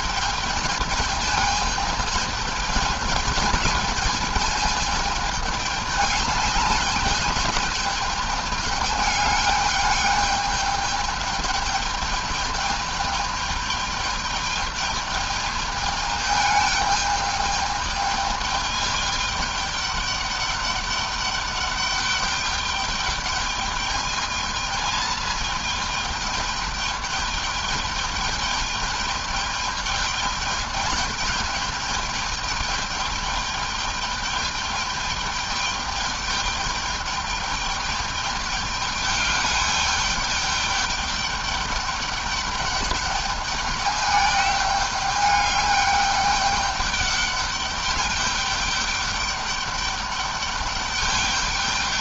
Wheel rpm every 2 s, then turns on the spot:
210, 210, 210, 210, 210, 210, 210, 210, 210, 210, 200, 210, 220, 210, 210, 210, 210, 210, 210, 210, 210, 210, 210, 200, 200, 200.
none